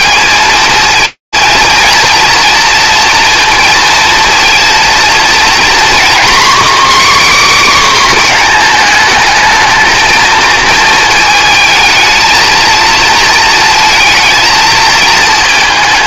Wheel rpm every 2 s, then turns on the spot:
220, 230, 230, 280, 230, 230, 220, 230.
none